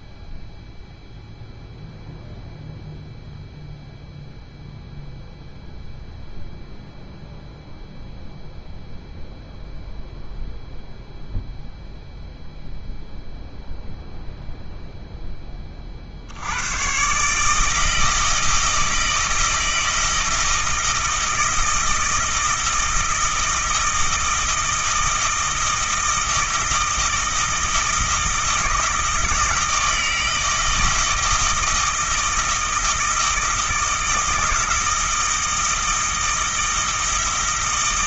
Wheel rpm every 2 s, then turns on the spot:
0, 0, 0, 0, 0, 0, 0, 0, 120, 160, 160, 160, 160, 160, 160, 160, 160, 160, 160.
none